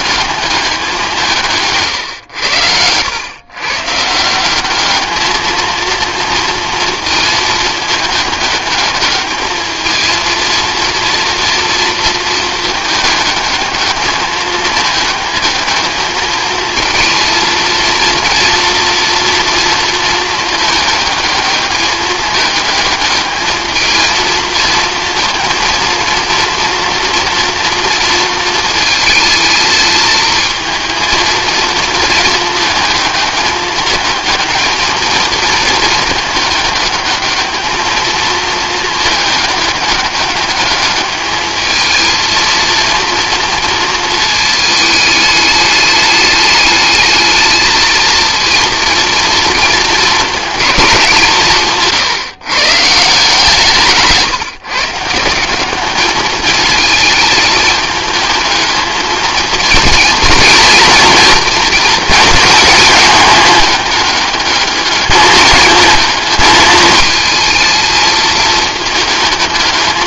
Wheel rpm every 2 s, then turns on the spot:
190, 100, 200, 230, 210, 230, 220, 220, 220, 230, 220, 220, 230, 240, 230, 230, 220, 220, 210, 220, 210, 230, 210, 210, 230, 210, 150, 150, 210, 220, 230, 220, 210, 220, 220.
none